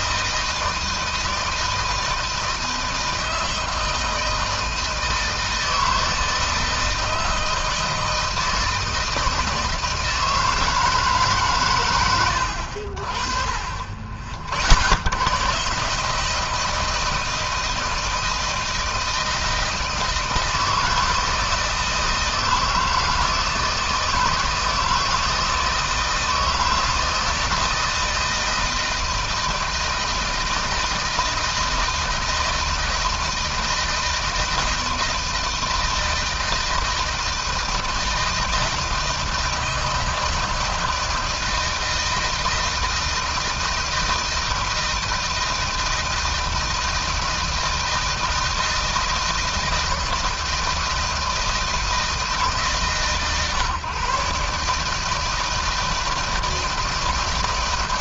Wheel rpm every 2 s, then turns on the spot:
160, 160, 160, 160, 160, 150, 60, 80, 160, 160, 160, 160, 160, 160, 160, 160, 160, 160, 160, 160, 160, 160, 160, 160, 160, 160, 150, 150, 160.
none